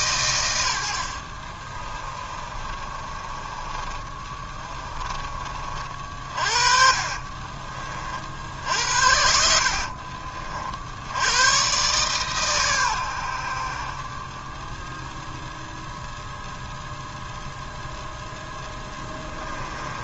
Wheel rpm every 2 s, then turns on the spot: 100, 30, 20, 40, 60, 70, 100, 10, 0, 20.
2-10 18-20